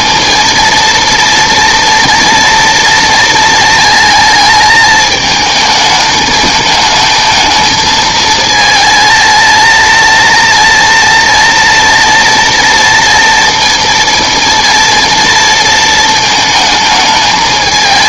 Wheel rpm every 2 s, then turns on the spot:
230, 230, 220, 210, 220, 230, 230, 230, 230.
none